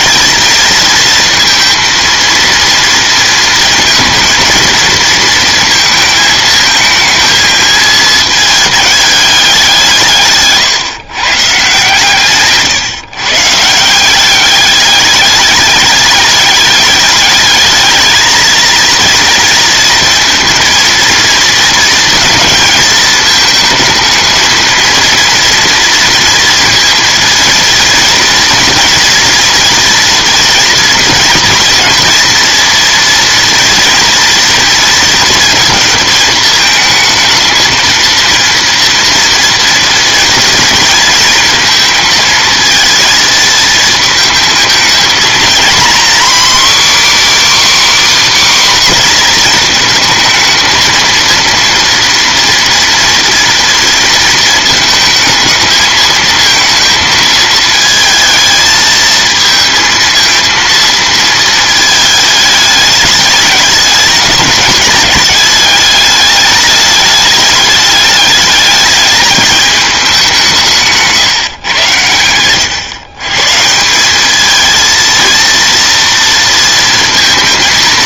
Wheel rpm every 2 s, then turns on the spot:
230, 230, 230, 220, 220, 140, 140, 200, 210, 230, 230, 220, 220, 230, 230, 230, 230, 230, 220, 230, 230, 230, 220, 280, 270, 220, 230, 220, 220, 220, 230, 210, 210, 210, 210, 170, 110, 220, 230.
none